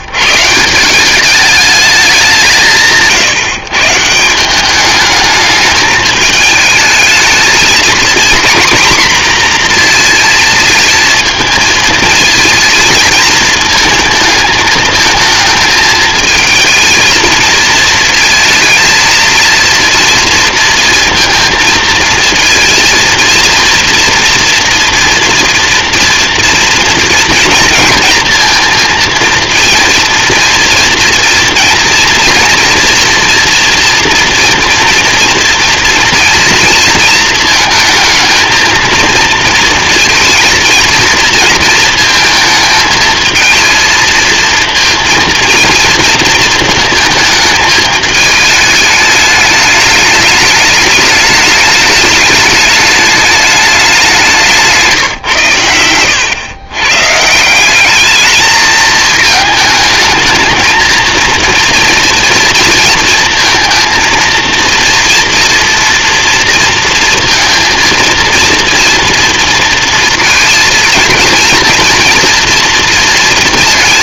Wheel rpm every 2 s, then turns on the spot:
170, 170, 210, 220, 240, 220, 220, 220, 220, 230, 230, 230, 230, 230, 230, 230, 230, 230, 230, 230, 230, 220, 230, 220, 210, 210, 210, 160, 120, 220, 220, 230, 230, 230, 230, 230, 230.
54-56